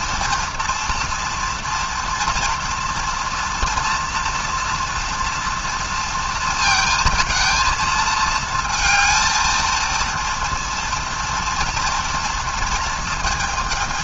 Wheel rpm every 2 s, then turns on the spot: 240, 230, 240, 230, 220, 230, 230.
none